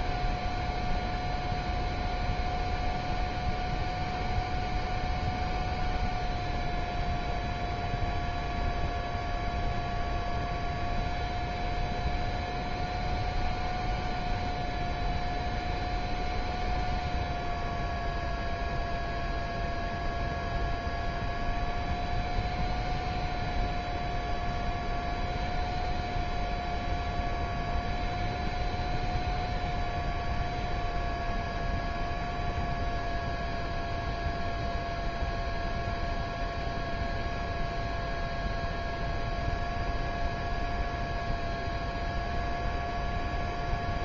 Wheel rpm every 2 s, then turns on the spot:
0, 0, 0, 0, 0, 0, 0, 0, 0, 0, 0, 0, 0, 0, 0, 0, 0, 0, 0, 0, 0, 0.
none